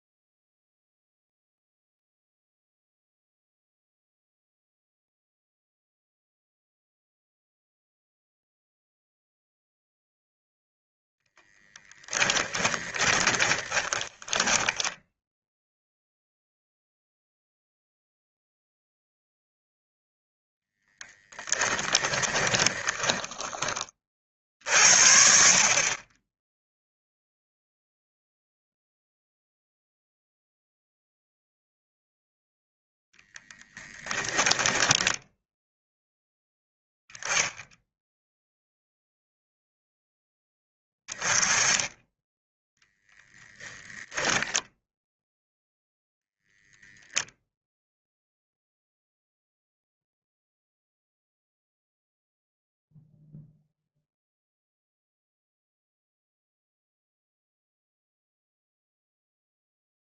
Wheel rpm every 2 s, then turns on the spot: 0, 0, 0, 0, 0, 10, 10, 10, 0, 0, 10, 30, 50, 0, 0, 0, 0, 10, 0, 0, 10, 0, 0, 0, 0, 0, 0, 0, 0, 0.
12-16 22-24 34-36